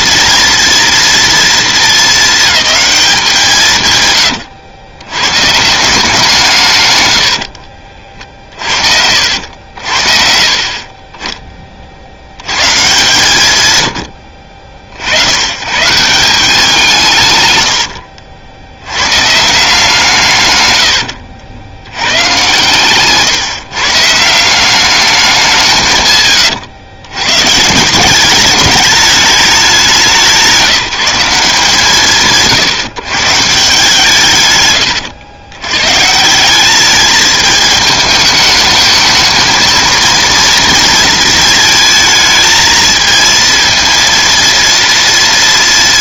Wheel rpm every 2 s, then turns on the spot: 230, 220, 110, 140, 60, 40, 120, 60, 180, 70, 120, 120, 190, 110, 210, 170, 150, 120, 190, 220, 230, 220, 230.
none